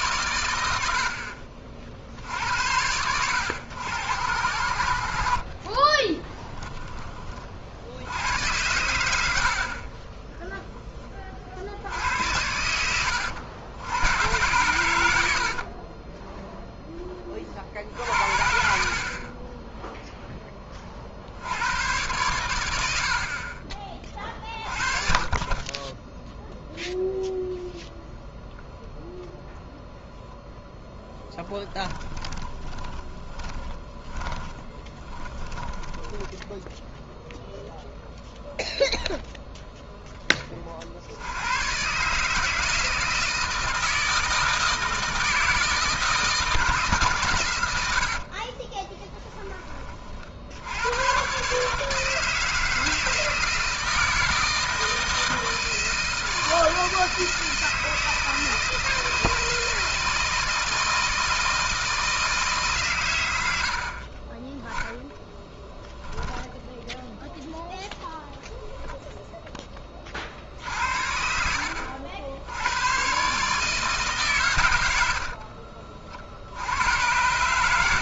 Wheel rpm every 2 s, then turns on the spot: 110, 80, 90, 10, 90, 10, 80, 100, 10, 60, 10, 100, 40, 0, 0, 0, 20, 20, 10, 0, 30, 150, 160, 160, 40, 70, 160, 160, 160, 160, 160, 150, 20, 10, 0, 60, 80, 130, 60.
6-8 32-36 48-50